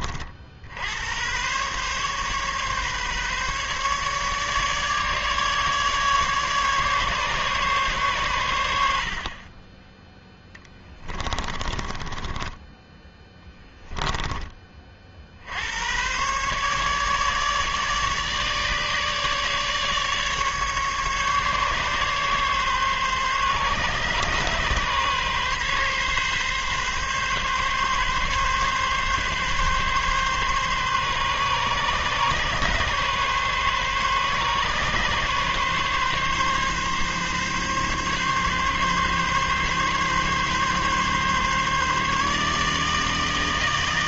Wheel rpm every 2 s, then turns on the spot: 80, 140, 150, 140, 80, 20, 10, 30, 140, 150, 140, 140, 140, 140, 140, 140, 140, 140, 140, 140, 140, 150.
10-14